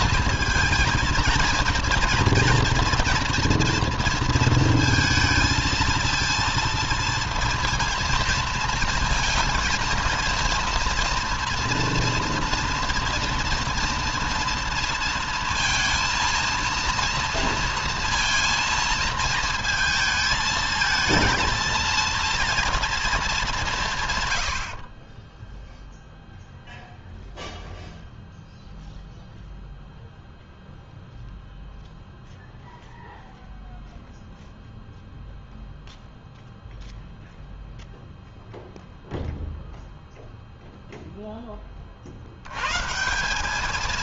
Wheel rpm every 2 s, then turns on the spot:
230, 230, 230, 230, 230, 230, 230, 230, 230, 230, 220, 230, 60, 0, 0, 0, 0, 0, 0, 0, 0, 150.
24-26